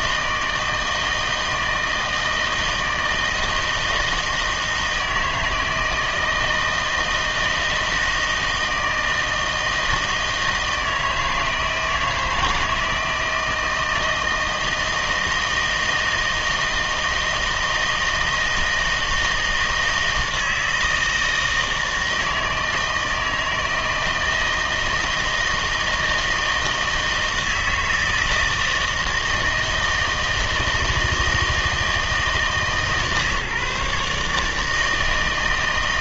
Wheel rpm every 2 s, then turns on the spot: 160, 160, 160, 160, 160, 160, 160, 160, 160, 160, 160, 160, 160, 160, 160, 160, 150, 150.
none